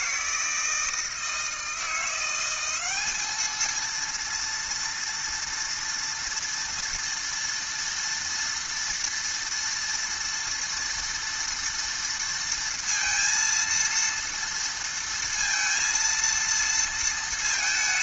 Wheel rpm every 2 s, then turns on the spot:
160, 190, 230, 230, 230, 230, 230, 230, 230.
none